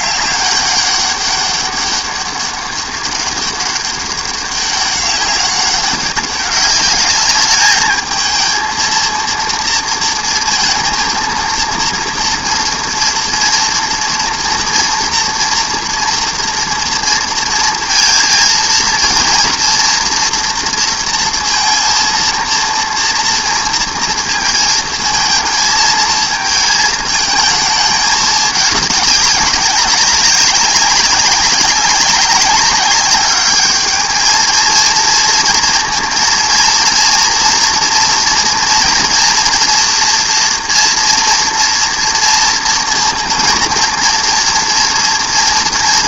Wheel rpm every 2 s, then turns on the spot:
200, 200, 200, 200, 220, 230, 230, 230, 240, 230, 230, 230, 230, 220, 210, 190, 200, 220, 230, 230, 230, 230, 240.
none